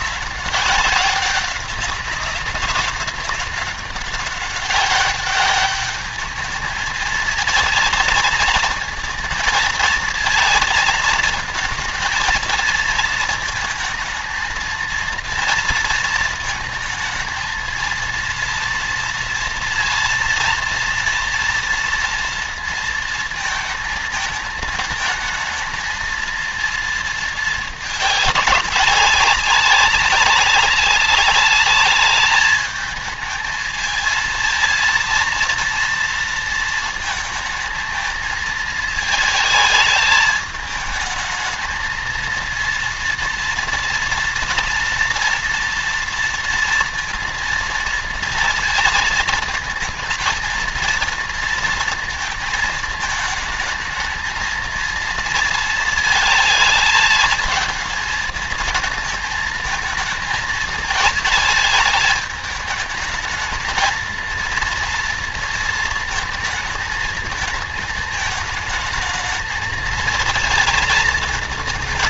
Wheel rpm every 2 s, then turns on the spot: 190, 190, 200, 220, 230, 230, 220, 220, 220, 230, 230, 230, 220, 230, 200, 200, 220, 230, 220, 220, 210, 230, 230, 230, 230, 230, 220, 230, 220, 220, 220, 220, 230, 220, 220, 230.
none